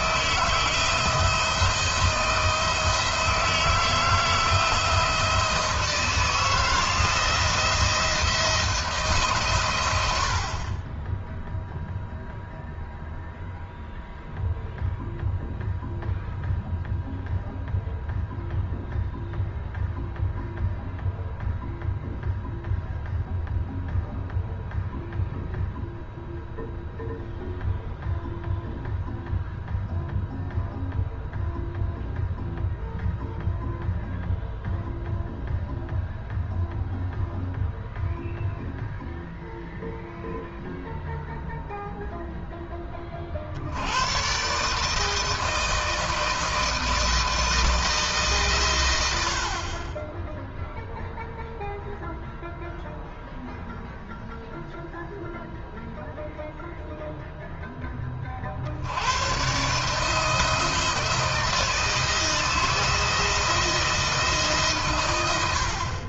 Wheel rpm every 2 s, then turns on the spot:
170, 170, 170, 170, 160, 40, 0, 0, 0, 0, 0, 0, 0, 0, 0, 0, 0, 0, 0, 0, 0, 10, 140, 160, 120, 0, 0, 0, 0, 50, 160, 160, 140.
none